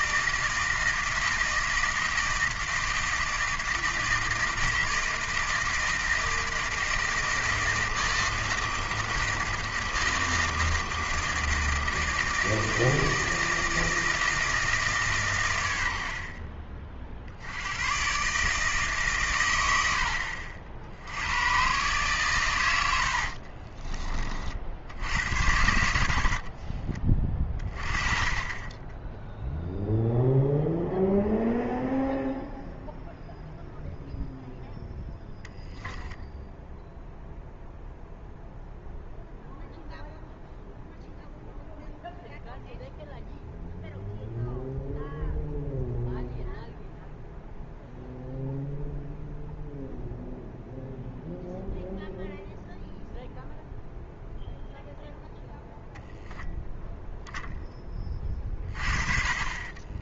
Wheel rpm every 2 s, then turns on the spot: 160, 160, 160, 160, 160, 160, 160, 160, 40, 150, 60, 110, 60, 40, 20, 0, 0, 0, 0, 0, 0, 0, 0, 0, 0, 0, 0, 0, 0, 40.
26-28